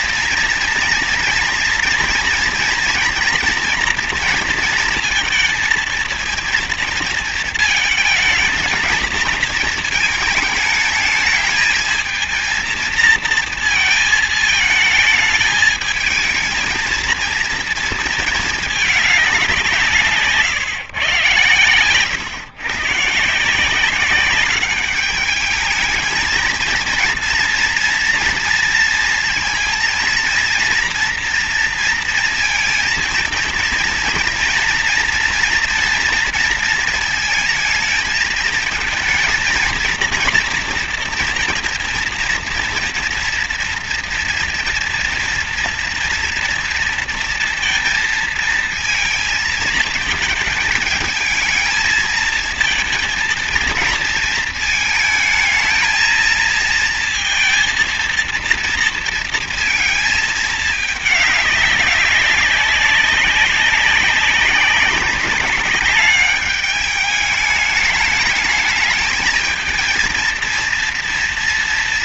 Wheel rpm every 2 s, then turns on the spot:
230, 230, 220, 230, 220, 220, 230, 220, 220, 220, 170, 140, 200, 230, 230, 230, 230, 230, 230, 230, 240, 230, 230, 230, 220, 220, 230, 220, 230, 230, 210, 190, 200, 210, 220, 230.
none